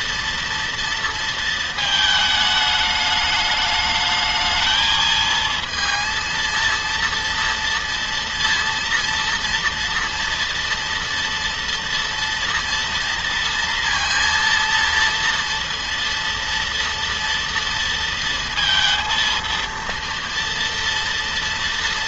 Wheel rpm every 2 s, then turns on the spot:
230, 210, 220, 230, 230, 230, 230, 230, 230, 230, 230.
none